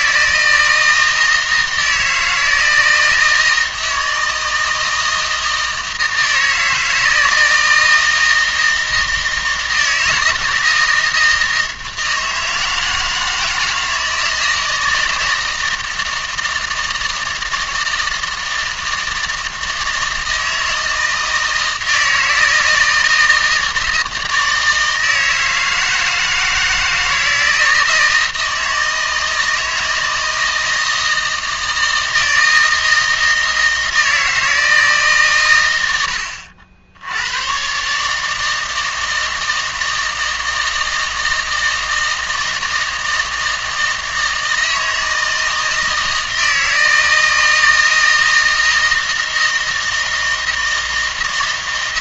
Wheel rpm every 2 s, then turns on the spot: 160, 160, 160, 160, 160, 160, 160, 160, 160, 160, 160, 160, 160, 160, 160, 160, 160, 160, 60, 160, 160, 160, 160, 160, 160, 160.
none